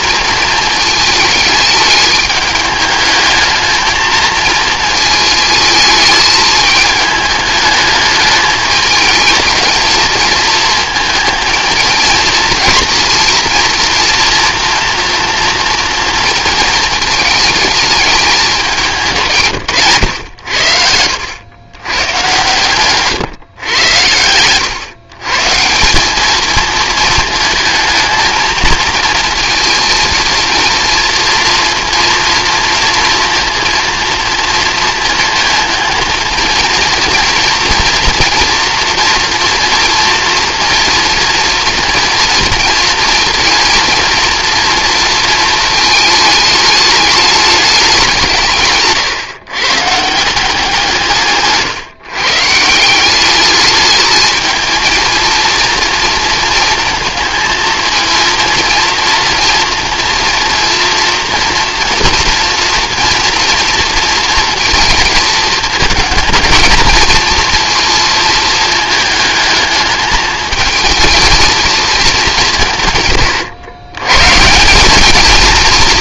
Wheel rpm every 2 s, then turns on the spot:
220, 210, 220, 210, 220, 230, 230, 230, 220, 180, 80, 140, 130, 230, 230, 230, 230, 230, 230, 240, 230, 230, 230, 210, 130, 170, 170, 220, 220, 230, 230, 230, 230, 230, 220, 220, 140, 190.
none